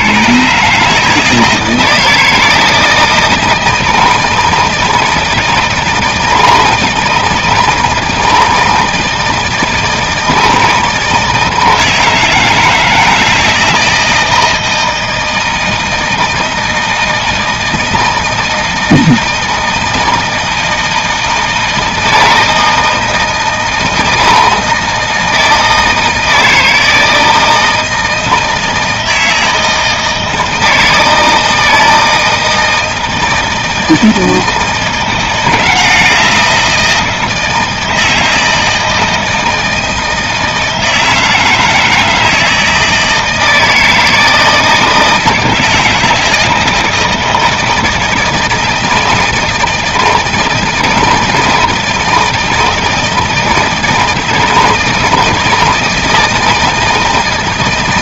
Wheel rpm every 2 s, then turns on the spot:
130, 160, 160, 160, 160, 160, 160, 160, 160, 160, 160, 160, 160, 160, 160, 160, 160, 160, 170, 160, 160, 160, 160, 170, 160, 160, 160, 160, 160.
none